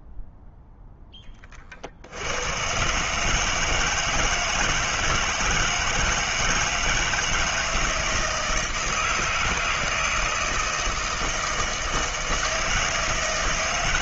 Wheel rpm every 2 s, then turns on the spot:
0, 120, 160, 160, 160, 160, 160.
none